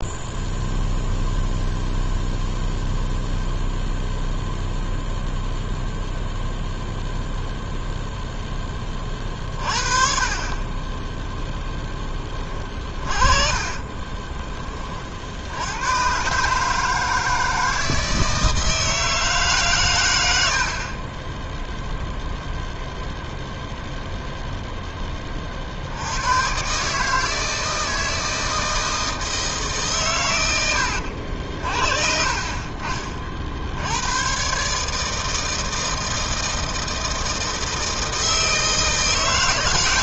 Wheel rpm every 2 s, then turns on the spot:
0, 0, 0, 0, 10, 30, 30, 20, 150, 160, 70, 0, 0, 130, 160, 90, 30, 140, 160, 160.
12-14